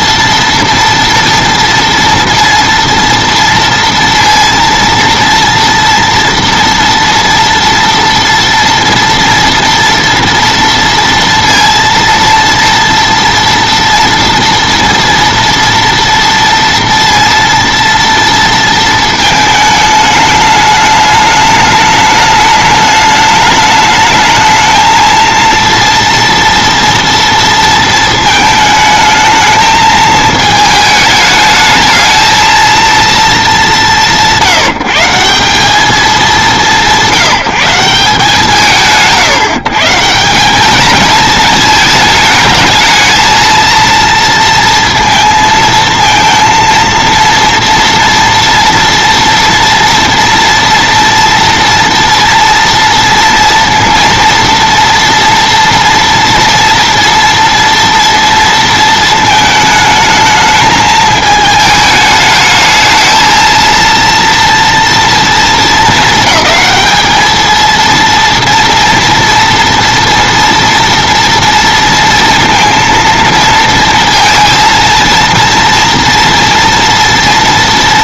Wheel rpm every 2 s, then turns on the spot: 230, 230, 230, 240, 230, 230, 230, 230, 230, 230, 210, 210, 220, 230, 220, 220, 230, 160, 170, 160, 220, 220, 230, 230, 230, 230, 230, 230, 230, 230, 220, 220, 230, 220, 230, 240, 230, 230, 230.
none